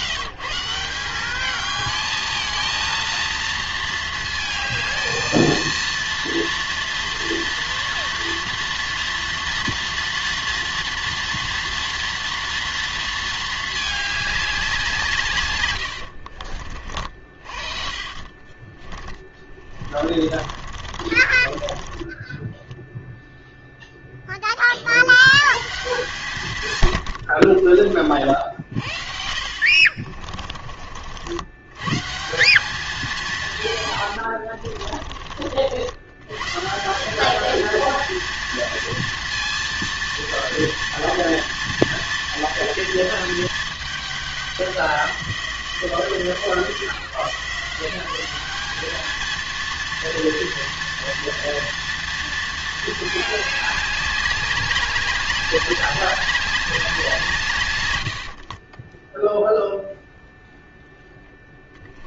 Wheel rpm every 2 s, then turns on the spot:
170, 220, 220, 230, 230, 230, 230, 190, 50, 30, 50, 10, 20, 140, 60, 30, 180, 70, 150, 230, 230, 230, 190, 150, 200, 230, 220, 200, 190, 40, 0.
16-18 20-22 30-32 34-36 58-60